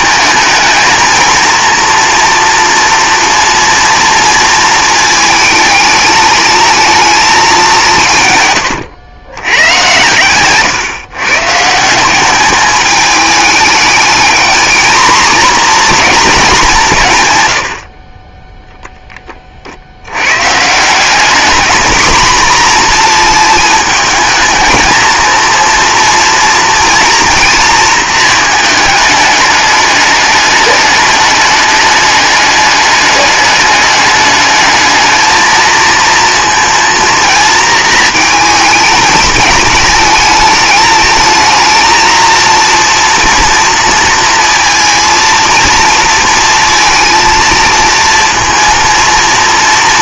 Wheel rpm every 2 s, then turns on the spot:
230, 230, 220, 220, 110, 140, 210, 220, 190, 0, 170, 240, 220, 230, 210, 210, 210, 220, 230, 220, 220, 230, 230, 230, 230.
none